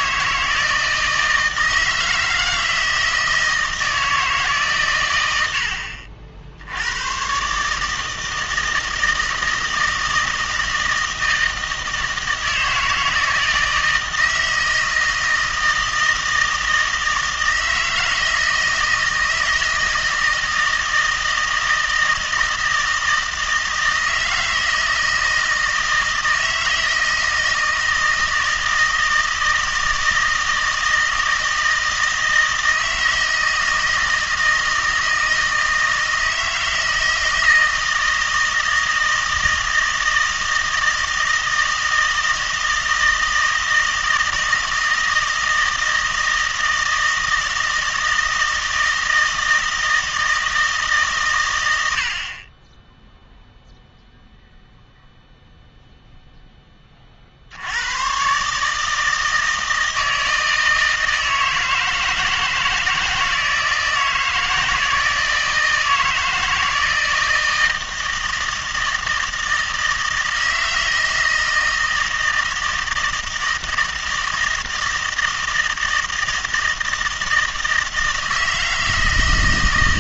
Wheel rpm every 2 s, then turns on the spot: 160, 160, 130, 90, 160, 160, 160, 160, 160, 160, 160, 160, 160, 160, 160, 160, 160, 160, 160, 160, 160, 160, 160, 160, 160, 150, 10, 0, 20, 150, 160, 160, 160, 160, 160, 160, 160, 160, 160, 160.
none